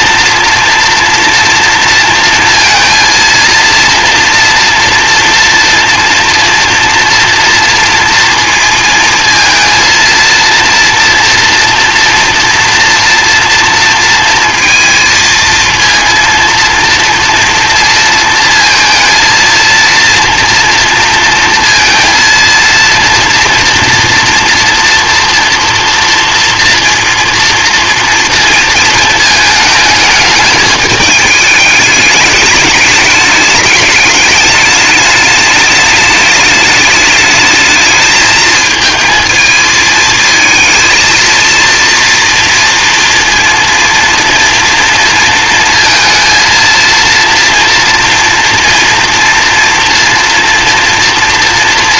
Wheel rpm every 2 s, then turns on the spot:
230, 230, 230, 230, 230, 230, 240, 230, 230, 230, 230, 230, 230, 230, 230, 210, 210, 210, 210, 220, 230, 230, 230, 230, 240, 230.
none